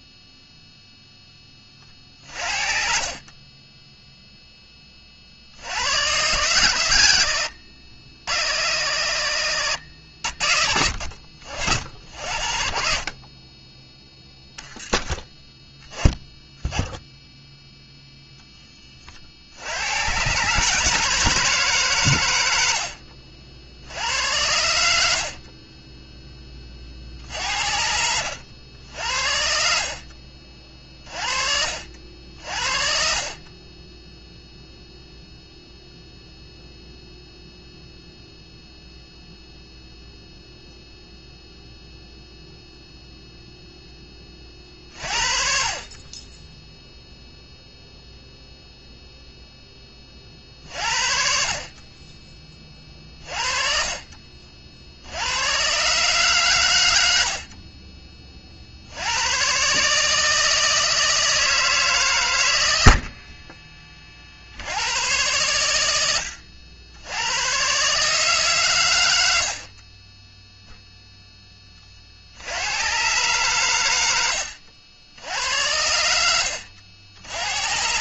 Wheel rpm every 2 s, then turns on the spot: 0, 40, 30, 110, 90, 60, 50, 10, 0, 30, 160, 70, 70, 50, 70, 40, 40, 0, 0, 0, 0, 0, 40, 0, 0, 50, 30, 70, 90, 80, 160, 70, 100, 90, 110, 0, 120, 80, 80.
2-4 22-26 62-64